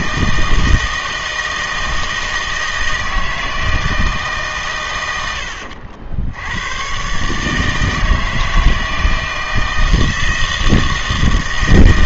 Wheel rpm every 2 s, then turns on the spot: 160, 160, 120, 100, 160, 160.
none